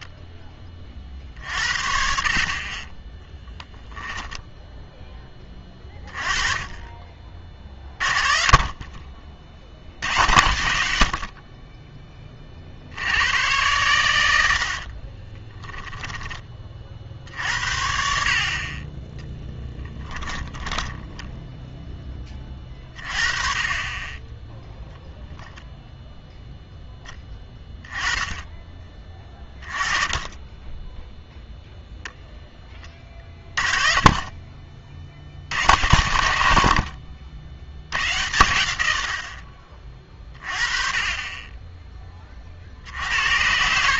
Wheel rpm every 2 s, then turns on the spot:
30, 30, 10, 30, 30, 90, 60, 60, 40, 30, 10, 30, 0, 10, 20, 10, 10, 40, 70, 90, 30, 60.
14-16